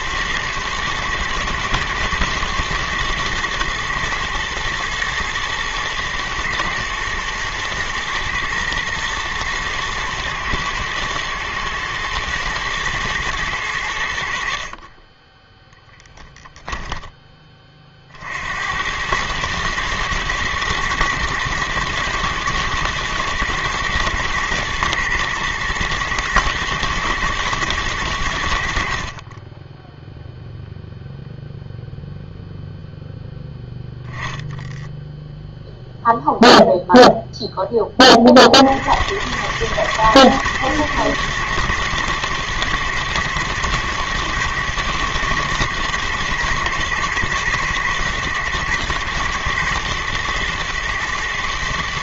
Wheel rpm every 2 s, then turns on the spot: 120, 110, 120, 120, 120, 110, 110, 10, 20, 110, 120, 110, 110, 110, 30, 0, 0, 0, 0, 80, 120, 120, 110, 120, 120, 120.
14-16